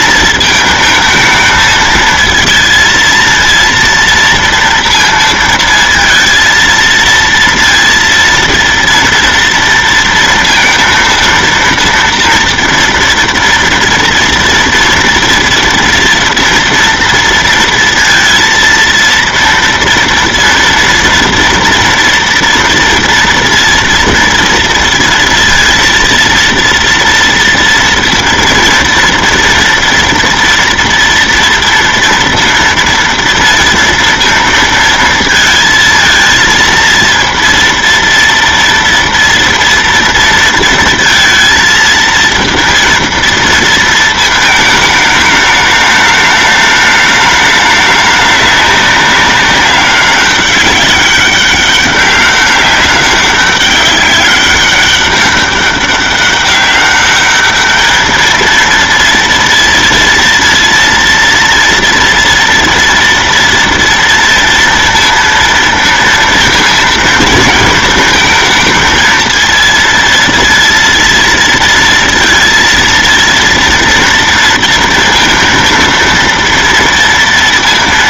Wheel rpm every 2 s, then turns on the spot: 220, 230, 230, 230, 230, 230, 230, 230, 230, 230, 230, 230, 230, 230, 230, 230, 230, 230, 230, 230, 230, 230, 220, 210, 200, 200, 200, 200, 200, 220, 230, 230, 230, 230, 220, 230, 230, 230, 230.
none